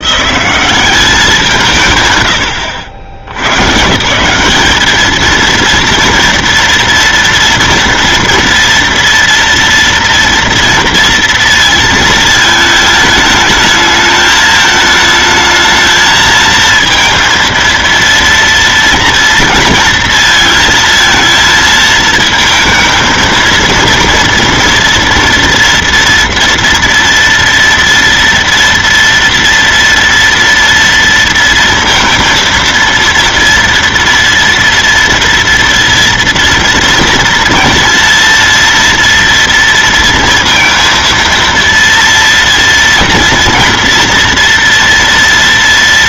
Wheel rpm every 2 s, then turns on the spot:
190, 80, 180, 230, 230, 230, 220, 220, 230, 230, 230, 220, 230, 240, 230, 230, 230, 230, 230, 230, 230, 230, 230.
none